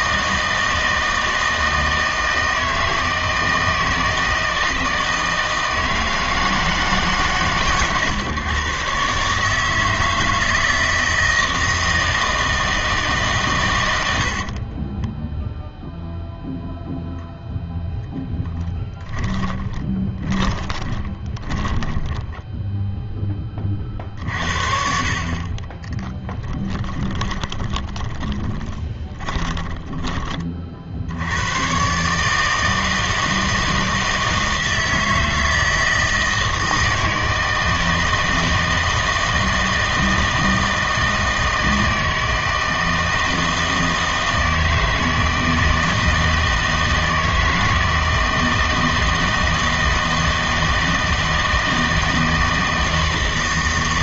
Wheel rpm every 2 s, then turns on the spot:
160, 160, 160, 160, 130, 160, 160, 30, 0, 10, 20, 10, 40, 20, 20, 50, 160, 160, 160, 160, 160, 160, 160, 160, 160, 160, 160.
18-24 26-30